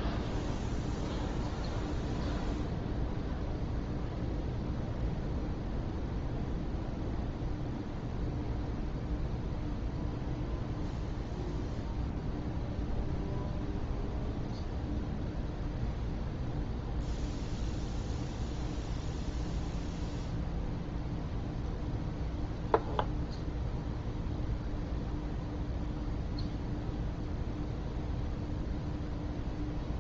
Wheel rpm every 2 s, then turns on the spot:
0, 0, 0, 0, 0, 0, 0, 0, 0, 0, 0, 0, 0, 0, 0.
none